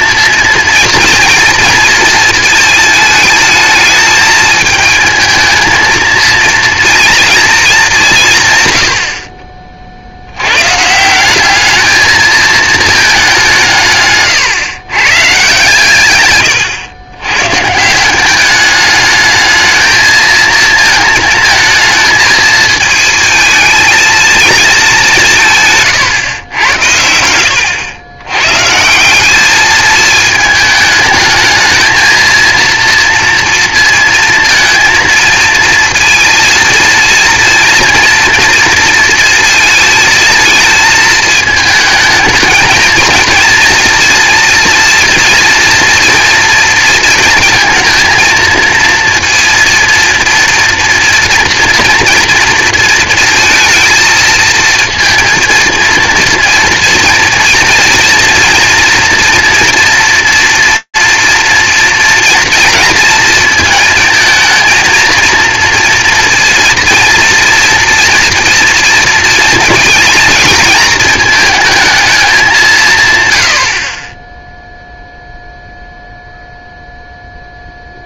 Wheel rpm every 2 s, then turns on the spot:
230, 220, 220, 230, 120, 120, 220, 120, 110, 200, 230, 220, 210, 100, 130, 210, 230, 230, 230, 230, 220, 220, 230, 230, 230, 230, 230, 220, 230, 240, 240, 230, 230, 230, 230, 220, 160, 0, 0.
none